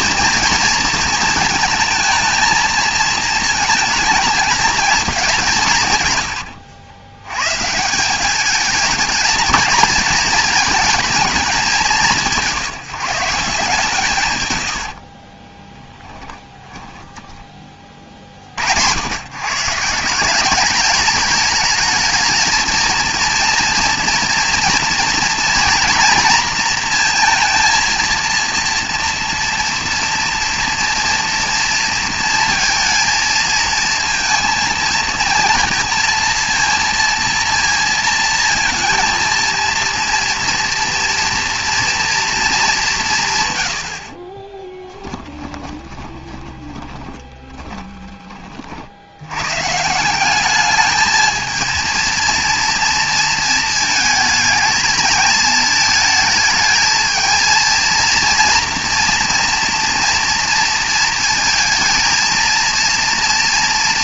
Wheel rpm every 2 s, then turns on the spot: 230, 220, 220, 80, 210, 220, 170, 80, 20, 70, 200, 230, 240, 230, 240, 230, 230, 230, 230, 220, 230, 210, 20, 20, 40, 210, 230, 220, 220, 240, 230, 230.
44-48